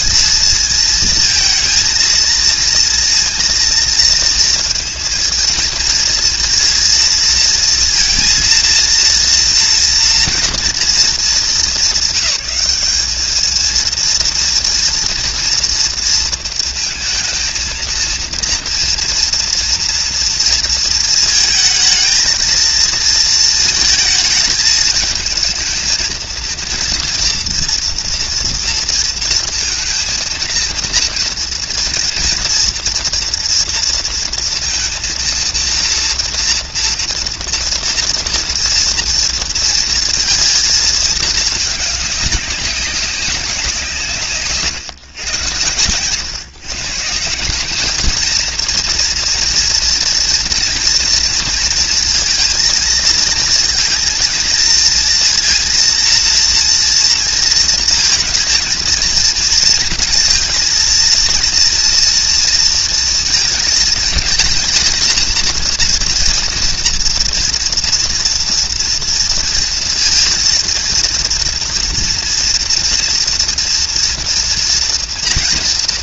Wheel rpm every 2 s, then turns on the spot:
220, 230, 230, 230, 230, 230, 200, 240, 220, 230, 230, 220, 220, 230, 230, 230, 240, 230, 240, 230, 230, 200, 140, 150, 230, 230, 230, 230, 230, 230, 230, 230, 220, 230, 230, 230, 230, 240.
44-46